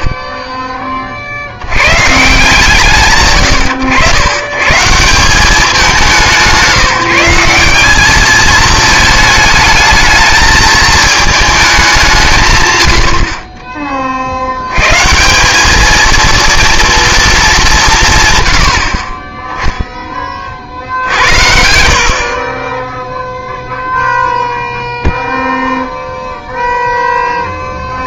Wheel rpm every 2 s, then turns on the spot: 20, 150, 140, 180, 220, 220, 130, 100, 230, 90, 50, 20, 0, 0.
22-24